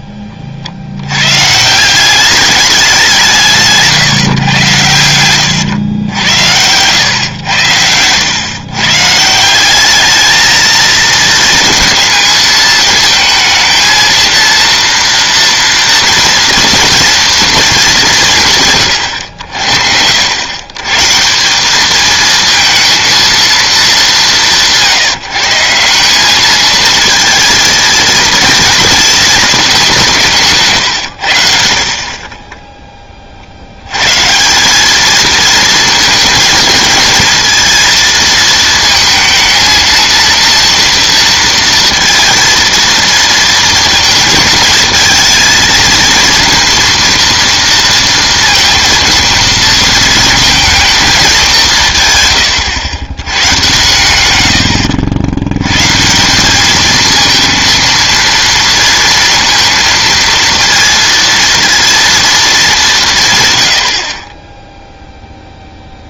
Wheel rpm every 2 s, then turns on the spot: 60, 200, 120, 90, 130, 220, 220, 230, 230, 140, 110, 220, 170, 220, 230, 140, 10, 180, 220, 230, 230, 230, 230, 230, 230, 230, 110, 80, 200, 230, 230, 220, 10.
none